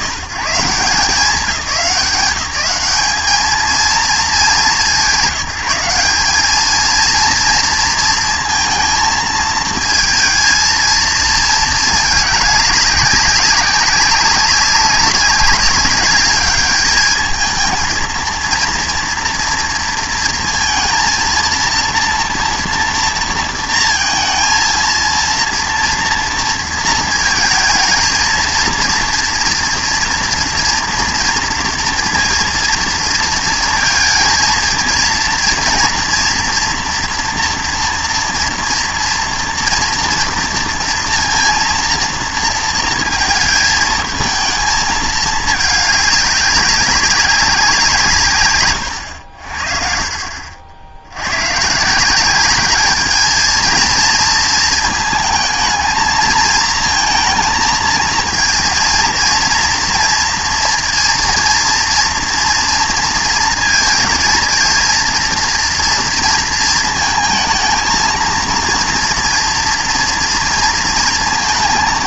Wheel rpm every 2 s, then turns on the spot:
90, 200, 200, 210, 230, 230, 200, 200, 210, 230, 230, 230, 230, 230, 230, 230, 230, 230, 230, 230, 230, 230, 220, 200, 130, 50, 190, 230, 230, 230, 230, 230, 230, 230, 230, 230.
none